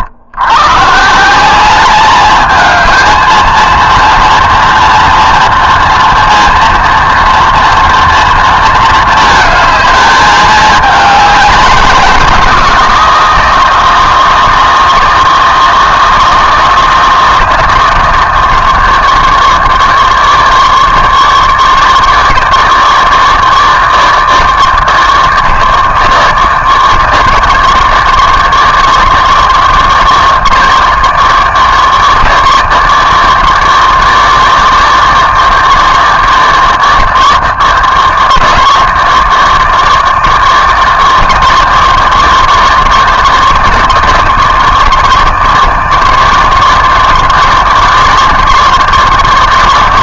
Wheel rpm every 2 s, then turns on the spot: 120, 220, 230, 230, 220, 210, 180, 160, 160, 160, 150, 160, 160, 150, 150, 160, 150, 160, 160, 160, 160, 150, 150, 150, 160.
none